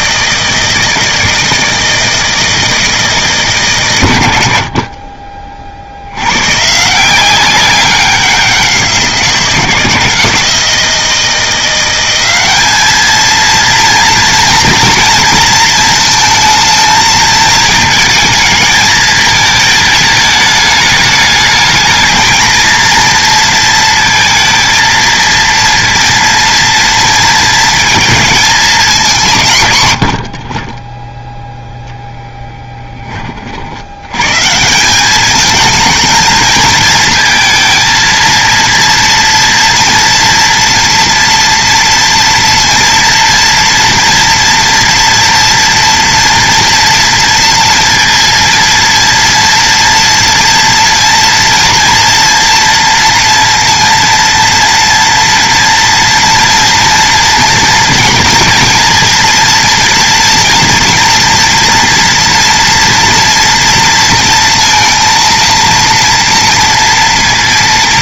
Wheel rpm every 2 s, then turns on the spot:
160, 160, 60, 140, 180, 160, 210, 230, 220, 220, 210, 220, 230, 230, 220, 30, 10, 160, 220, 230, 230, 230, 240, 230, 230, 240, 230, 230, 230, 230, 230, 230, 230, 230.
30-32